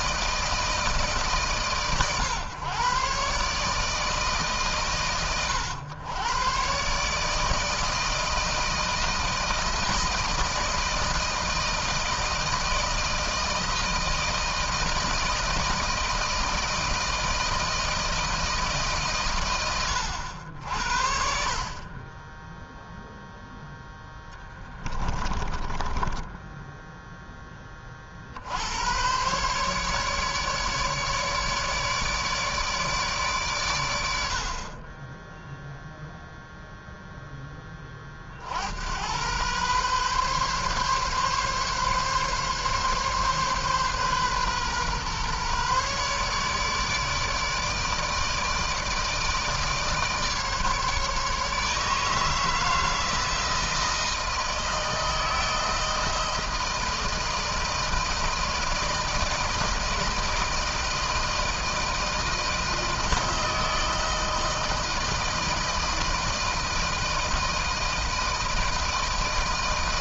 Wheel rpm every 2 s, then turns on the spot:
160, 120, 140, 120, 160, 160, 160, 160, 160, 160, 80, 10, 10, 10, 90, 150, 150, 40, 0, 70, 140, 140, 130, 150, 160, 150, 160, 160, 160, 160, 160, 160, 160, 160, 160.
26-28